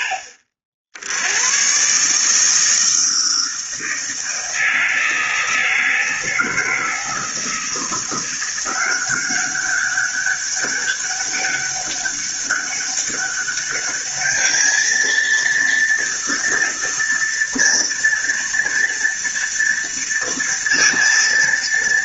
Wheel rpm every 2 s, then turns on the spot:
70, 160, 160, 160, 180, 200, 200, 220, 230, 230, 230.
none